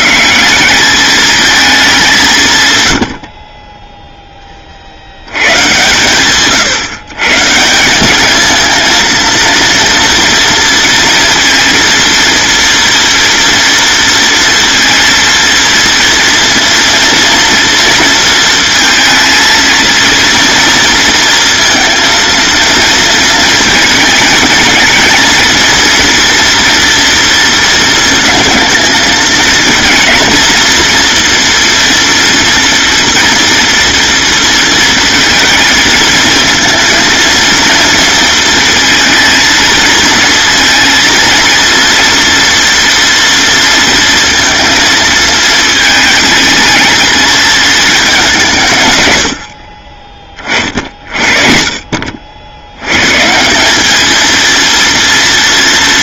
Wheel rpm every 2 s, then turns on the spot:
200, 110, 60, 130, 230, 230, 230, 230, 230, 230, 230, 230, 230, 230, 220, 230, 230, 230, 230, 230, 230, 230, 230, 220, 110, 50, 130, 230.
none